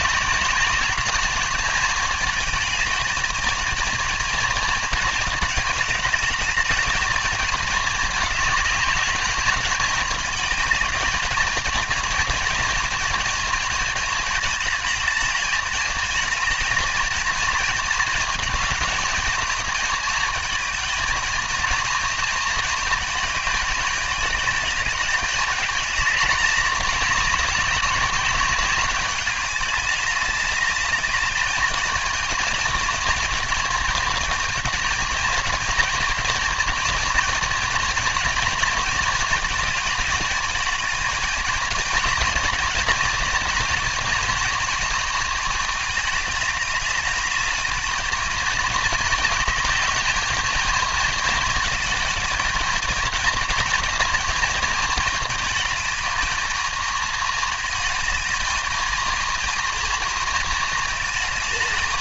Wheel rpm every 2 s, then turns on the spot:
210, 220, 220, 220, 210, 220, 220, 220, 220, 220, 220, 220, 210, 210, 200, 210, 230, 230, 230, 230, 220, 230, 220, 210, 220, 220, 220, 220, 220, 220, 220.
none